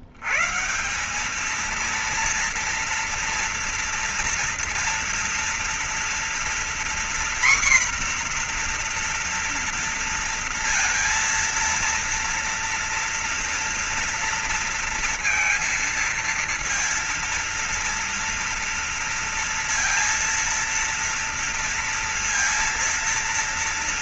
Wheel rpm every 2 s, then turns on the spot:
100, 230, 230, 230, 250, 230, 230, 230, 230, 230, 230, 230.
none